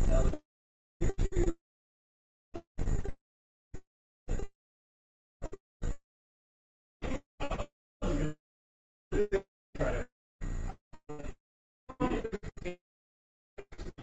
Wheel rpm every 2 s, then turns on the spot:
0, 0, 0, 0, 0, 0, 0.
none